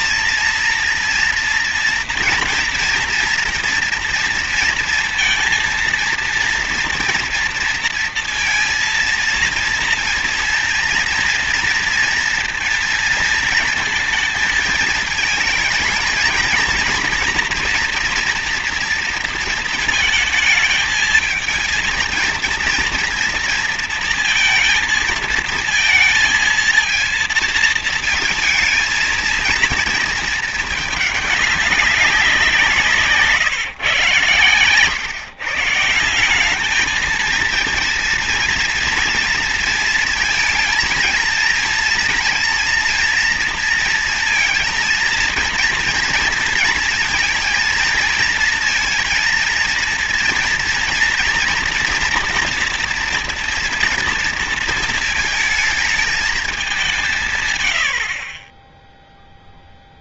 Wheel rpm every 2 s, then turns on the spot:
230, 230, 230, 240, 230, 230, 230, 220, 230, 230, 220, 230, 230, 220, 220, 210, 170, 120, 210, 230, 230, 230, 230, 230, 230, 230, 230, 220, 190, 10.
none